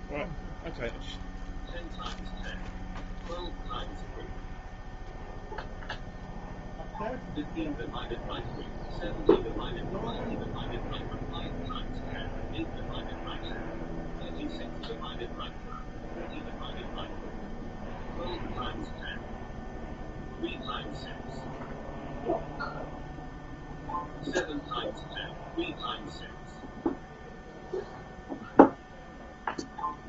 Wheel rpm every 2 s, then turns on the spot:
0, 0, 0, 0, 0, 0, 0, 0, 0, 0, 0, 0, 0, 0, 0.
none